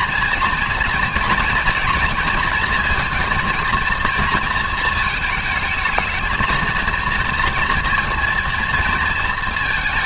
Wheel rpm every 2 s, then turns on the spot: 240, 230, 230, 220, 230.
none